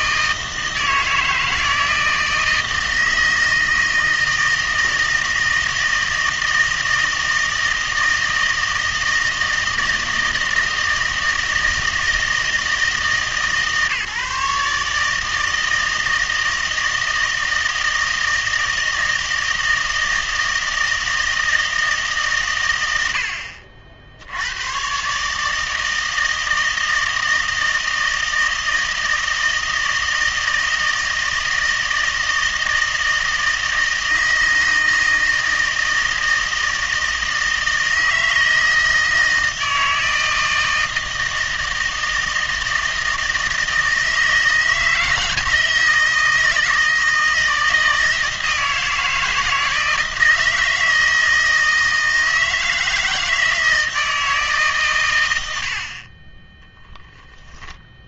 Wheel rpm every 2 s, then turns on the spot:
160, 160, 160, 160, 160, 160, 160, 150, 160, 160, 160, 130, 100, 160, 160, 160, 160, 160, 160, 160, 160, 160, 160, 160, 170, 160, 160, 150, 10.
none